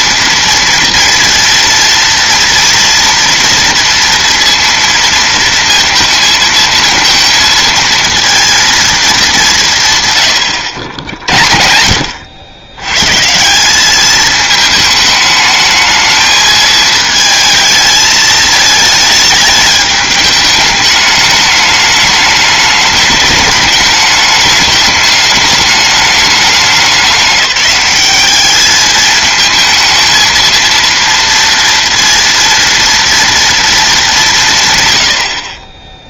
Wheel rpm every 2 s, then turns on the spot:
230, 230, 230, 230, 230, 80, 100, 220, 220, 220, 210, 210, 210, 200, 210, 230, 230, 130.
none